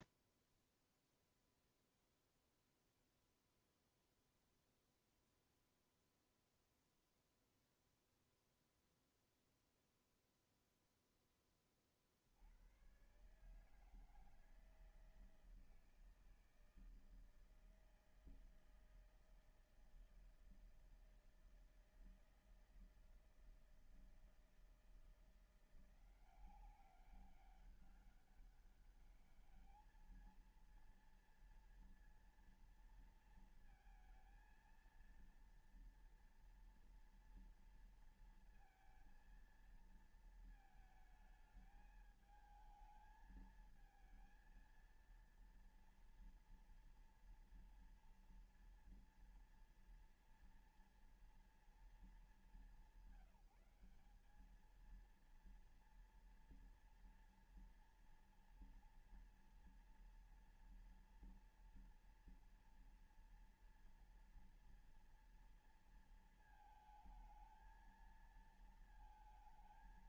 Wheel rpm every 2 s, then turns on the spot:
0, 0, 0, 0, 0, 0, 100, 160, 160, 160, 160, 160, 160, 180, 200, 230, 230, 230, 230, 230, 220, 220, 230, 240, 230, 230, 190, 210, 230, 230, 230, 230, 230, 220, 220.
none